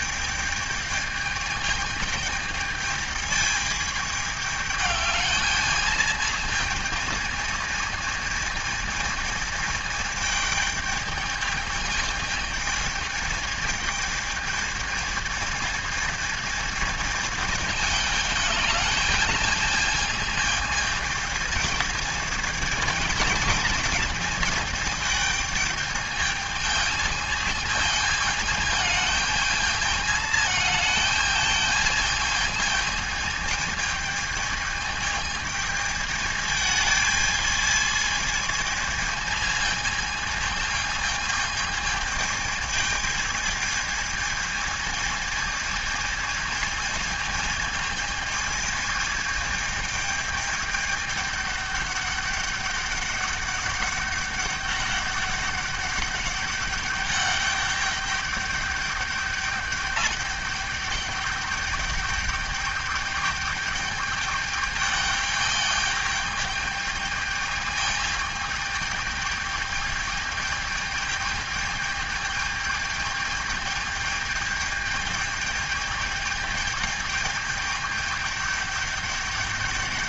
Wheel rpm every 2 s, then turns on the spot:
210, 210, 210, 220, 220, 220, 220, 220, 220, 210, 220, 220, 220, 220, 220, 220, 220, 220, 220, 220, 220, 220, 220, 220, 220, 210, 200, 200, 200, 200, 200, 210, 210, 210, 210, 210, 210, 210, 210, 200.
none